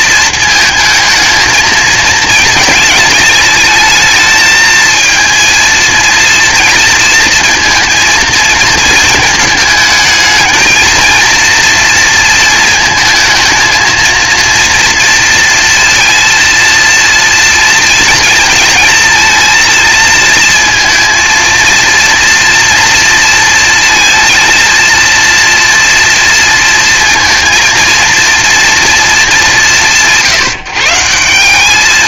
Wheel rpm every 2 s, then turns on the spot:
230, 220, 220, 230, 220, 220, 220, 230, 230, 230, 230, 230, 230, 230, 230, 160.
none